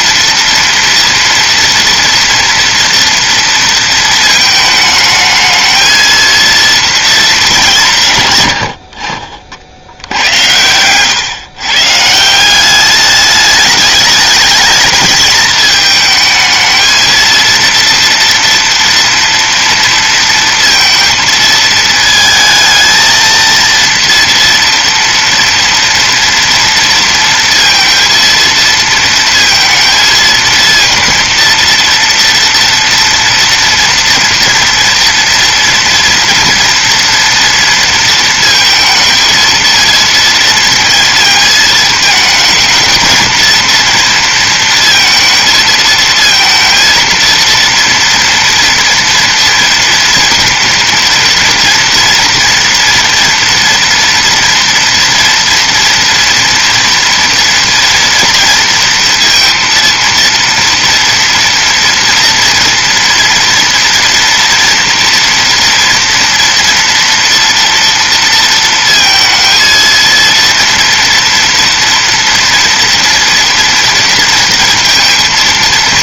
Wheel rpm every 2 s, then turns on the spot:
230, 230, 220, 230, 60, 100, 200, 220, 220, 230, 230, 220, 230, 230, 230, 230, 230, 240, 240, 220, 230, 220, 230, 230, 230, 230, 230, 230, 230, 230, 230, 230, 230, 230, 230, 230, 240, 230.
none